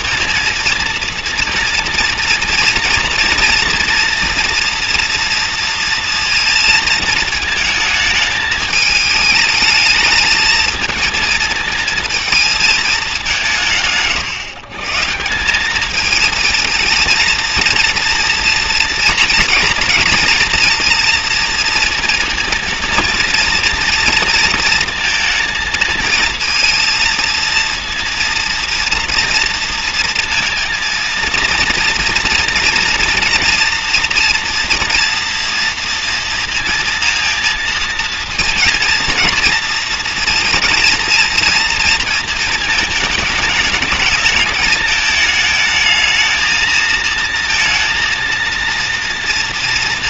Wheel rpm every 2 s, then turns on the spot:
230, 230, 230, 230, 220, 220, 220, 130, 230, 230, 240, 230, 230, 230, 230, 230, 230, 240, 230, 230, 230, 220, 220, 220, 230.
none